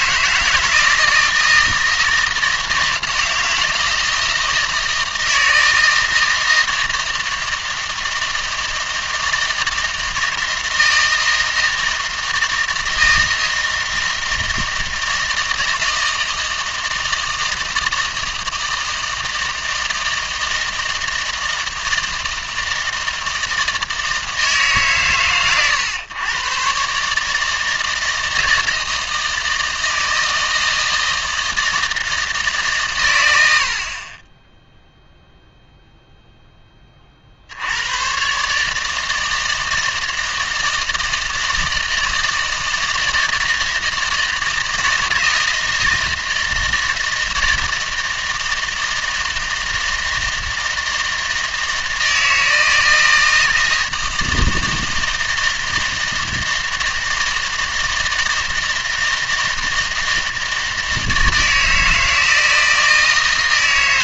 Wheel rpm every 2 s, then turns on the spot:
160, 160, 160, 160, 160, 160, 160, 160, 160, 160, 160, 160, 150, 120, 160, 160, 150, 0, 20, 150, 160, 160, 160, 160, 160, 160, 160, 160, 160, 160, 160, 160.
none